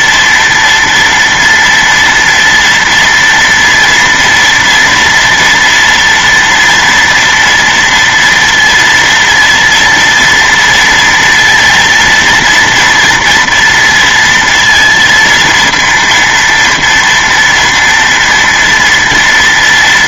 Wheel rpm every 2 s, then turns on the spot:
230, 230, 230, 230, 230, 240, 230, 230, 230, 230.
none